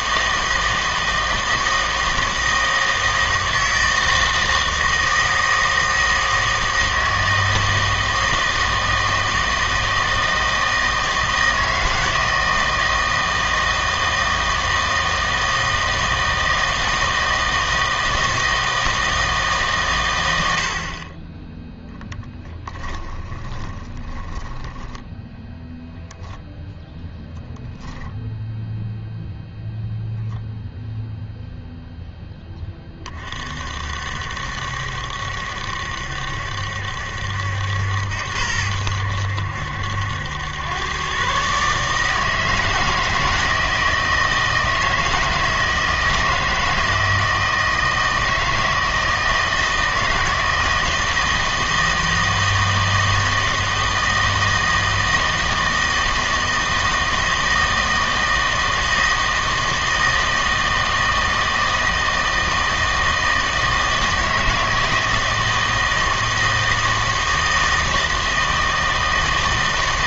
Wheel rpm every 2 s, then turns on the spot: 160, 160, 160, 160, 160, 160, 160, 160, 160, 160, 70, 10, 10, 0, 0, 0, 20, 70, 70, 80, 100, 160, 160, 160, 160, 160, 160, 160, 160, 160, 160, 160, 160, 160, 160.
22-26